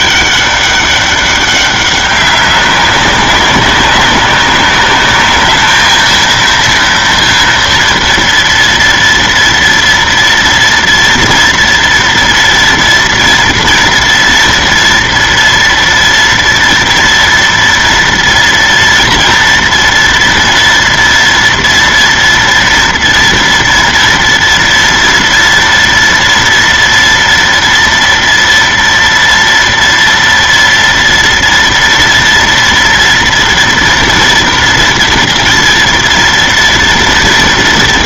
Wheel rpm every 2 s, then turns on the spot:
200, 200, 200, 230, 230, 240, 230, 230, 230, 230, 230, 230, 230, 230, 230, 230, 230, 240, 230.
none